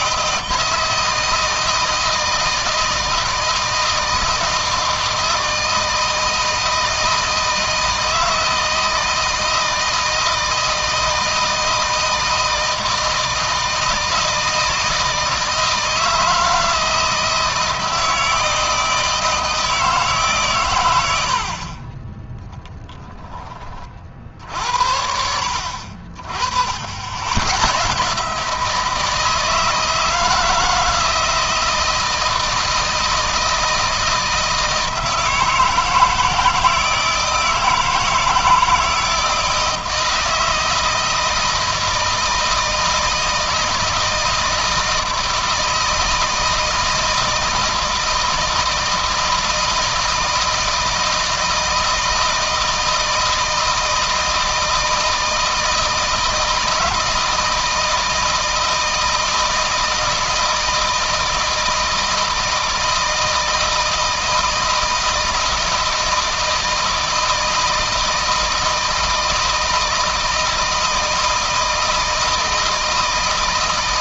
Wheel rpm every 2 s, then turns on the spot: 160, 160, 160, 160, 160, 160, 160, 160, 160, 160, 90, 10, 70, 80, 160, 160, 160, 160, 160, 160, 160, 160, 160, 160, 160, 160, 160, 160, 160, 160, 160, 160, 160, 160, 160, 160, 160.
none